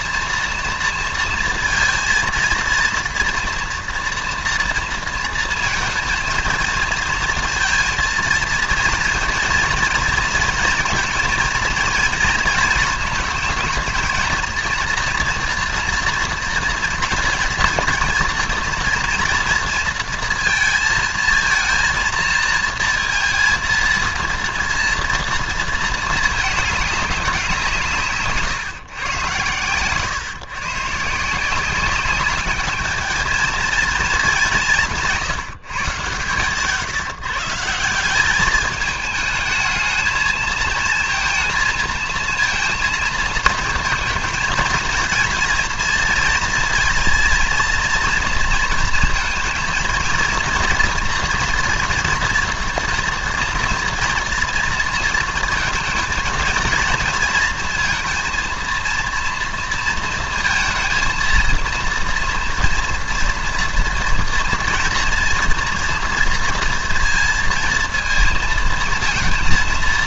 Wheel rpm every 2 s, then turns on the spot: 230, 230, 230, 220, 230, 230, 230, 230, 230, 230, 220, 230, 230, 210, 140, 140, 210, 190, 120, 210, 220, 230, 230, 230, 230, 230, 240, 230, 230, 230, 230, 240, 230, 240, 230.
none